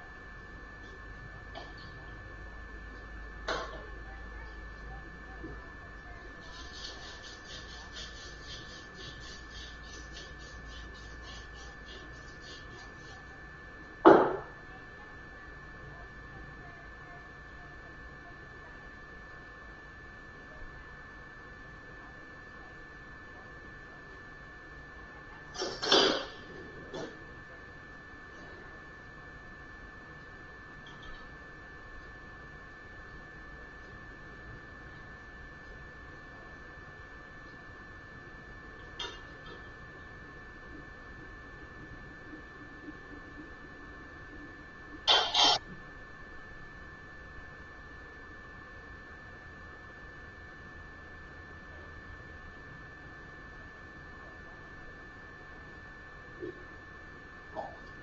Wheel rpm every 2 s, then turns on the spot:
0, 0, 0, 0, 0, 0, 0, 0, 0, 0, 0, 0, 0, 0, 0, 0, 0, 0, 0, 0, 0, 0, 0, 0, 0, 0, 0, 0, 0.
none